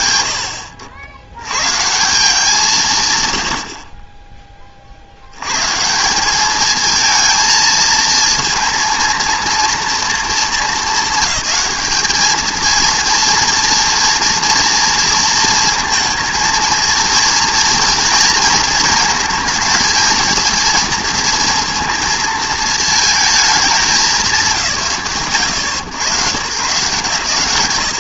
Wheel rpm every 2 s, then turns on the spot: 80, 130, 50, 220, 230, 220, 230, 230, 230, 220, 230, 220, 140, 130.
none